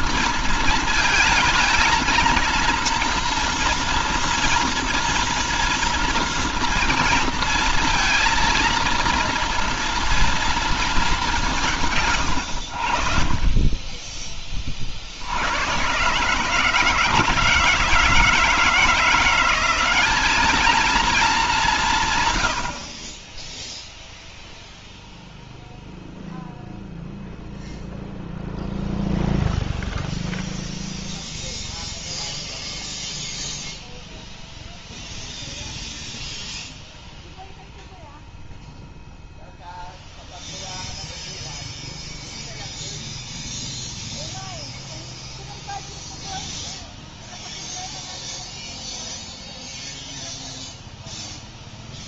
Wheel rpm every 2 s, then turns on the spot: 220, 230, 230, 230, 230, 220, 70, 40, 150, 160, 220, 80, 0, 0, 0, 0, 0, 0, 0, 0, 0, 0, 0, 0, 0, 0.
none